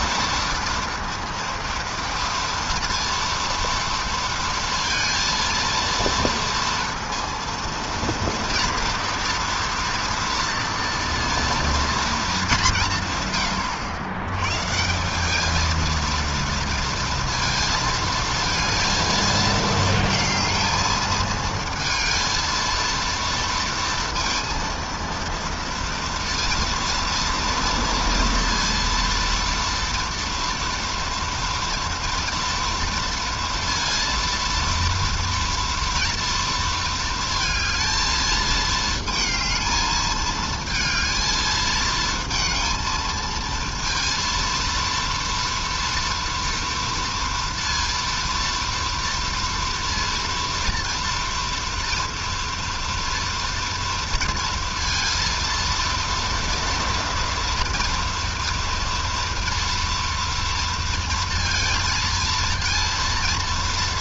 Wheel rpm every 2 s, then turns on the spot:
230, 230, 230, 230, 230, 230, 110, 210, 230, 230, 220, 230, 230, 230, 230, 230, 230, 230, 230, 220, 220, 230, 230, 230, 230, 230, 230, 230, 230, 230, 230, 230.
none